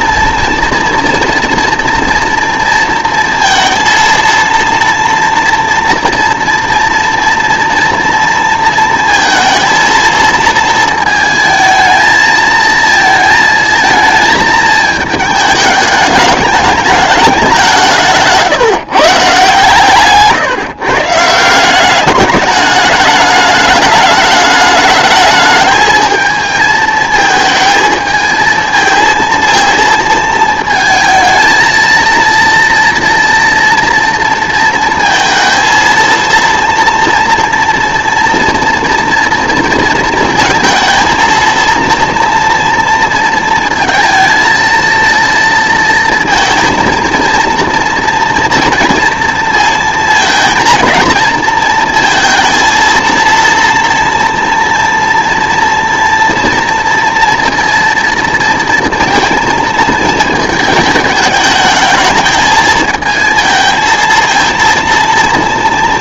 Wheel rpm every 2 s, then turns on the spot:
230, 230, 230, 240, 230, 220, 220, 220, 210, 150, 150, 210, 210, 220, 220, 230, 230, 230, 230, 230, 220, 230, 230, 230, 230, 230, 230, 230, 230, 230, 220, 220, 230.
none